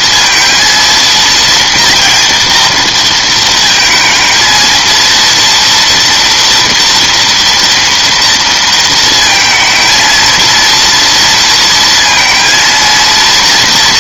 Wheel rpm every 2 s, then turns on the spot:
230, 220, 230, 230, 230, 230, 240.
none